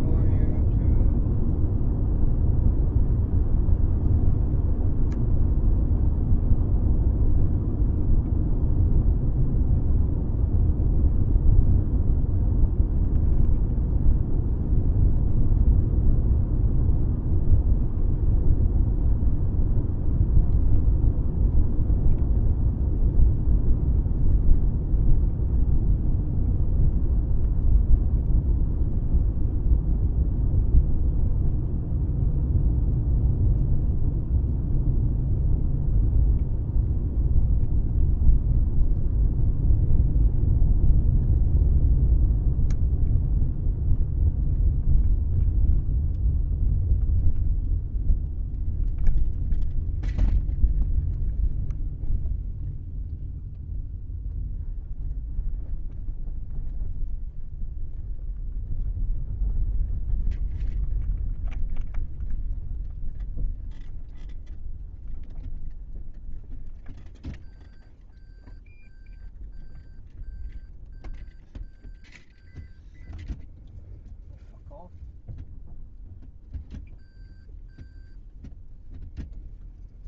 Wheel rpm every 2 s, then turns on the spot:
0, 0, 0, 0, 0, 0, 0, 0, 0, 0, 0, 0, 0, 0, 0, 0, 0, 0, 0, 0, 0, 0, 0, 0, 0, 0, 0, 0, 0, 0, 0, 0, 0, 0, 0, 0, 0, 0, 0, 0.
none